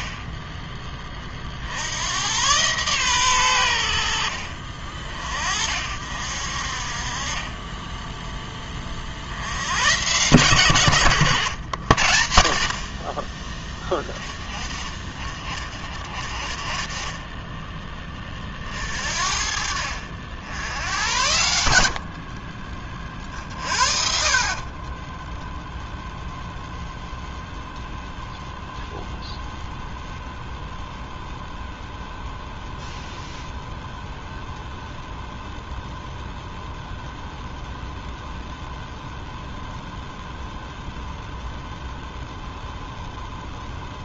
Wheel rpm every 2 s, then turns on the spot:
10, 120, 40, 50, 20, 120, 60, 20, 30, 40, 80, 30, 40, 0, 0, 0, 0, 0, 0, 0, 0, 0.
none